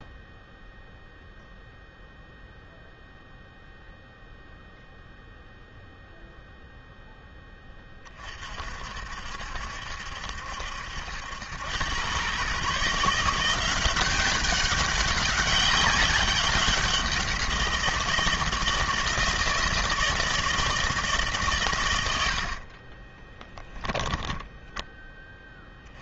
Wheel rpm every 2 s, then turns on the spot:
0, 0, 0, 0, 50, 70, 140, 200, 190, 160, 160, 40, 10.
22-24